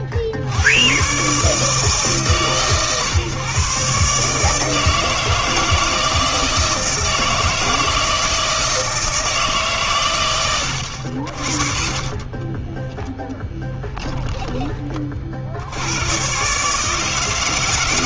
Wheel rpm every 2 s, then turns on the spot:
100, 130, 160, 160, 160, 80, 0, 20, 150.
none